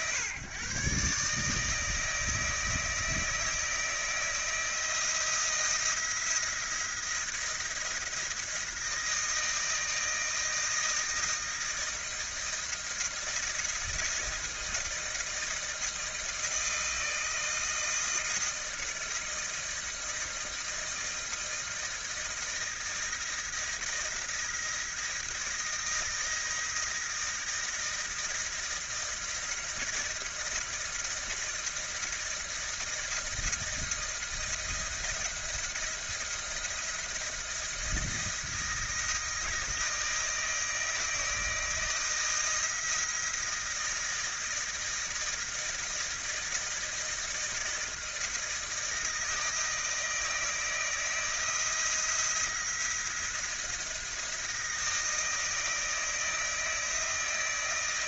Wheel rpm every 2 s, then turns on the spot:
130, 160, 160, 170, 170, 160, 170, 160, 160, 160, 160, 160, 160, 160, 160, 160, 160, 170, 170, 160, 160, 160, 160, 160, 160, 160, 170, 160, 160.
none